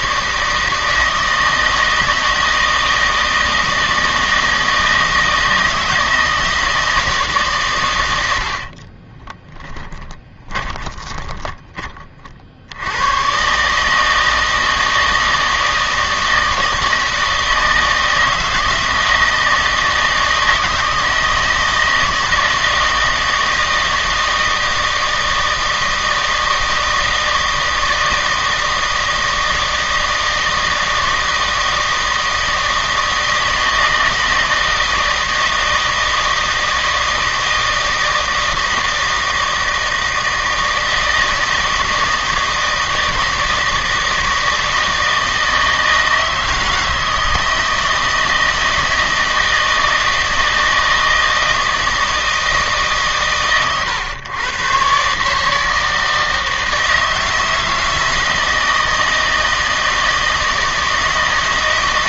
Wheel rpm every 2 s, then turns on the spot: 160, 160, 160, 160, 50, 20, 80, 160, 160, 160, 160, 160, 160, 160, 160, 160, 160, 160, 160, 160, 160, 160, 160, 160, 160, 160, 150, 130, 160, 160, 160.
8-12